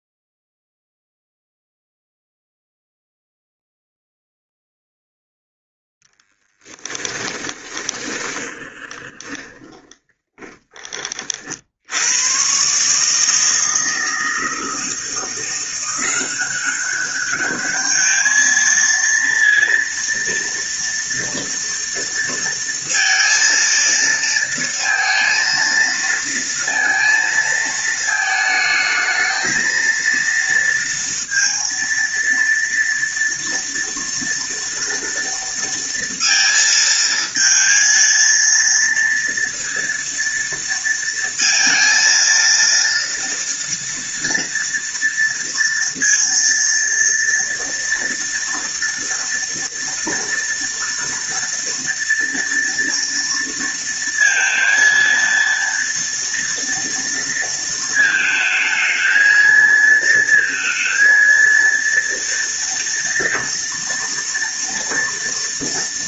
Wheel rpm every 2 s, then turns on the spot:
0, 0, 0, 20, 20, 30, 140, 160, 190, 230, 230, 230, 230, 230, 220, 230, 230, 230, 230, 230, 230, 230, 230, 230, 230, 230, 230, 230, 230, 220, 230, 230, 230.
6-10